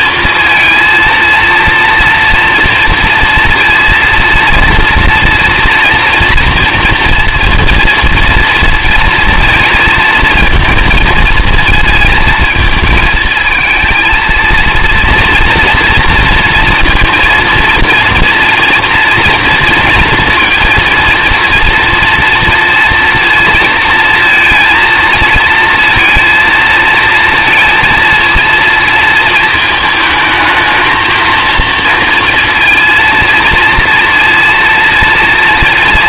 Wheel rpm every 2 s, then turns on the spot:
220, 240, 230, 240, 230, 220, 220, 230, 230, 230, 230, 230, 230, 230, 230, 220, 230, 230.
none